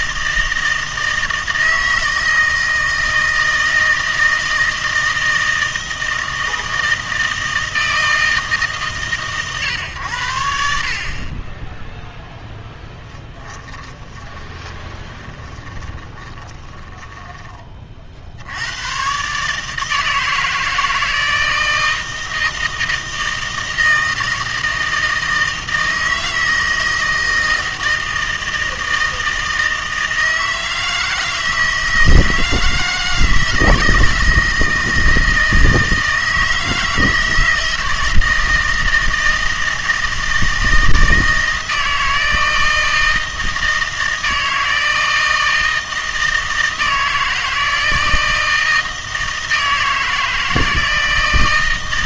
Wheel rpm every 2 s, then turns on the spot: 160, 160, 160, 160, 150, 70, 0, 20, 10, 90, 160, 160, 160, 160, 160, 160, 160, 160, 160, 160, 160, 160, 160, 160, 160, 160.
14-18